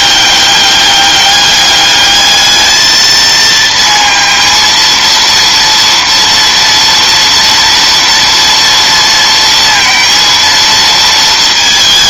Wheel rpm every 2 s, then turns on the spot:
200, 220, 230, 230, 230, 230.
none